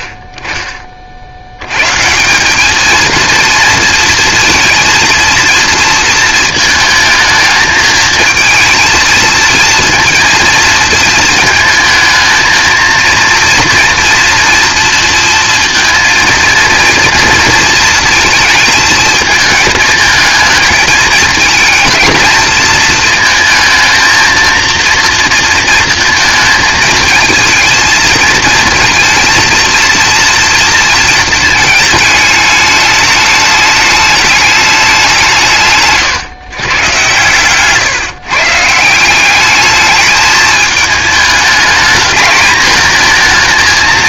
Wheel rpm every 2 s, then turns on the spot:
40, 200, 230, 220, 220, 230, 230, 230, 230, 220, 220, 230, 230, 220, 220, 230, 210, 200, 130, 140, 210, 220.
none